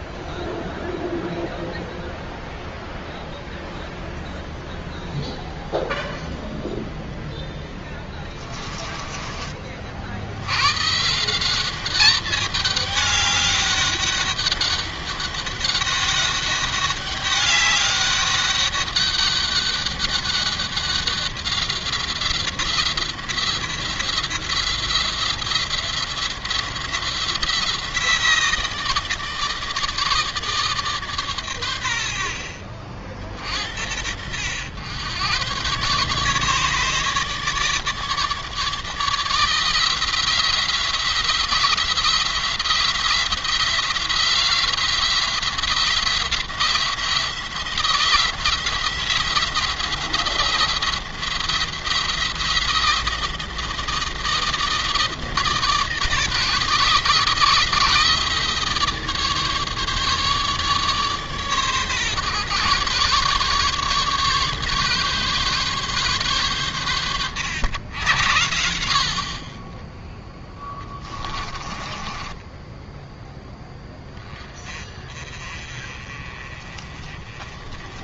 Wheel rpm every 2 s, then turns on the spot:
0, 0, 0, 0, 20, 120, 200, 200, 200, 200, 190, 180, 180, 180, 170, 150, 60, 90, 150, 150, 170, 170, 170, 170, 170, 170, 170, 160, 150, 160, 150, 140, 140, 120, 60, 10, 10, 30, 30.
8-10 70-74